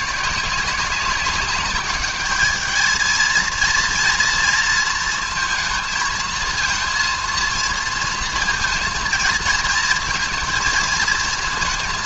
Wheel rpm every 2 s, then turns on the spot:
190, 220, 230, 230, 230, 220.
none